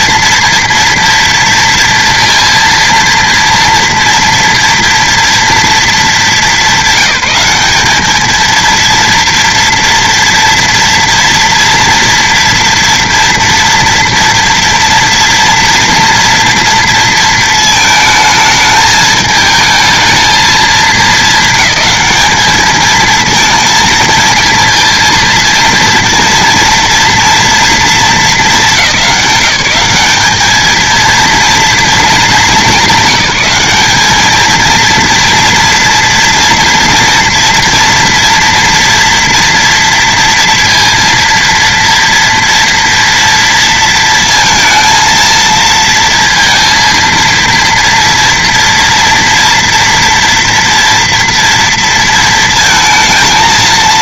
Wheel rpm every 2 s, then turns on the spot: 230, 230, 240, 200, 230, 230, 240, 230, 230, 220, 220, 220, 230, 230, 210, 220, 190, 230, 230, 240, 230, 230, 230, 230, 230, 230, 230.
none